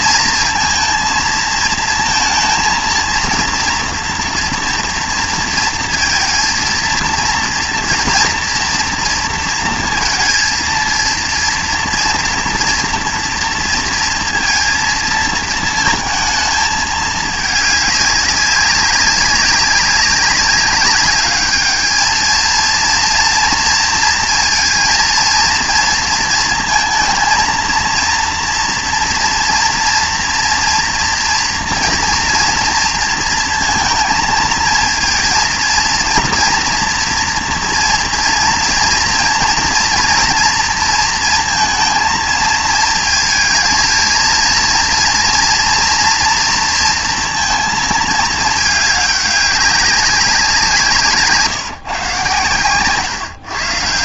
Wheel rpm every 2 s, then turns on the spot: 230, 230, 230, 230, 230, 230, 230, 230, 220, 200, 190, 230, 230, 230, 230, 230, 230, 220, 230, 230, 230, 220, 230, 230, 210, 180, 130.
none